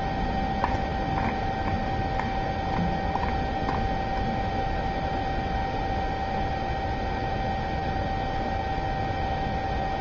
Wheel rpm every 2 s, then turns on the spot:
0, 0, 0, 0, 0.
none